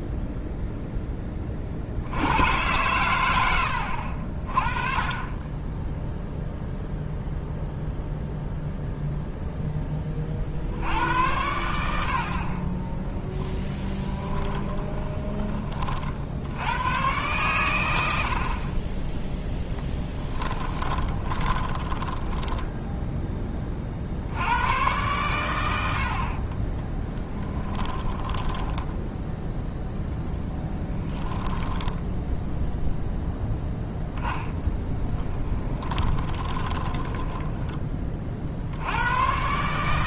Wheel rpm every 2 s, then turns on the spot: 0, 110, 30, 0, 0, 60, 30, 20, 90, 40, 20, 10, 90, 30, 10, 10, 0, 10, 20, 60.
14-16 18-24 26-32 34-38